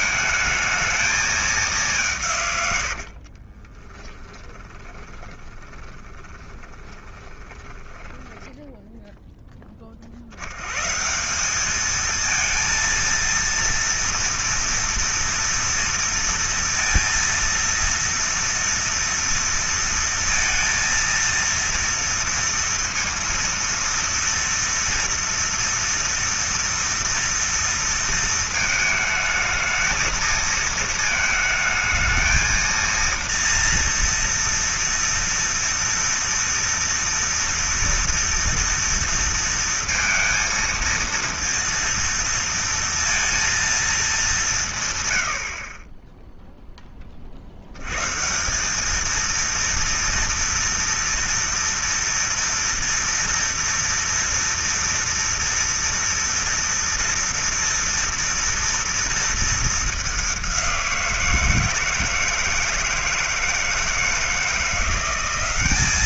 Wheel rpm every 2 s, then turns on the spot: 220, 120, 10, 20, 10, 100, 230, 230, 230, 230, 230, 230, 230, 230, 220, 220, 230, 230, 230, 230, 230, 230, 170, 10, 190, 230, 230, 230, 230, 230, 190, 160, 170.
4-10